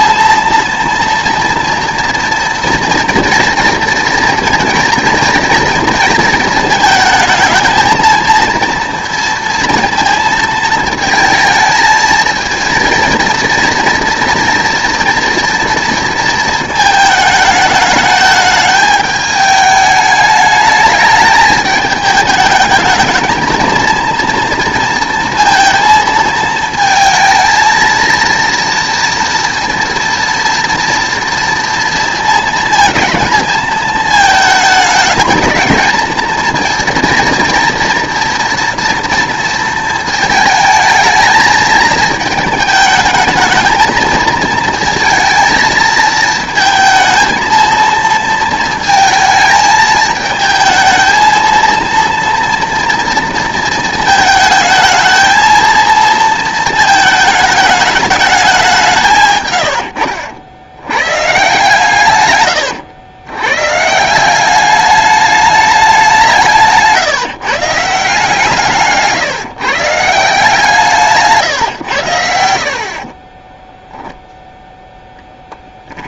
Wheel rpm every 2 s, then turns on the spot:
230, 230, 230, 220, 230, 230, 230, 230, 220, 210, 210, 220, 230, 230, 230, 230, 220, 220, 230, 230, 220, 220, 230, 220, 220, 220, 230, 220, 220, 170, 90, 110, 200, 170, 150, 160, 40, 0.
68-70